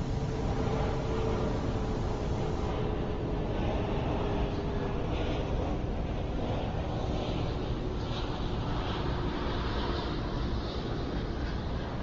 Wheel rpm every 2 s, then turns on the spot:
0, 0, 0, 0, 0, 0.
none